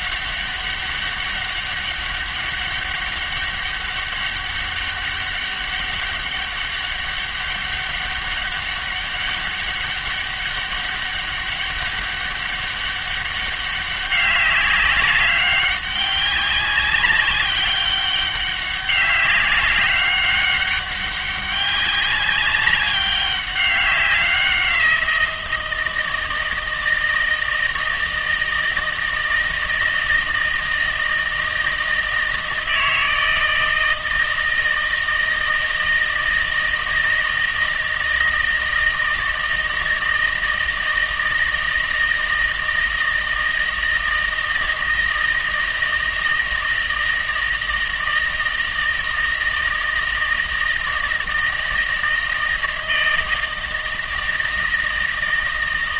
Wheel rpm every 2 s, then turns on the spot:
200, 200, 200, 200, 200, 200, 200, 200, 190, 200, 200, 200, 180, 160, 160, 160, 160, 160, 160, 160, 160, 160, 160, 160, 160, 160, 160, 160.
none